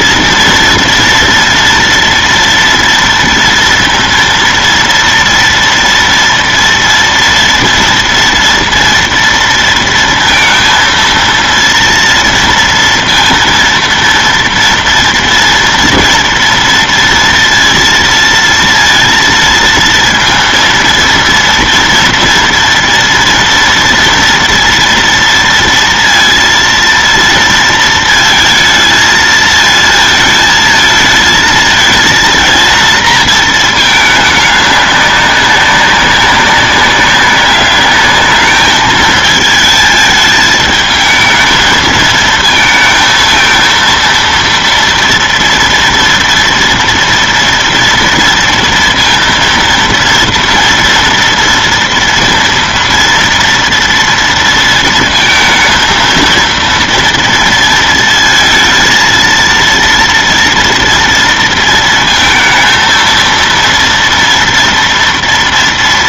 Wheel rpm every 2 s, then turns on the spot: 230, 230, 230, 240, 240, 230, 230, 230, 230, 230, 230, 230, 230, 230, 220, 220, 230, 200, 190, 210, 220, 220, 230, 230, 230, 230, 230, 230, 230, 230, 230, 230, 230.
none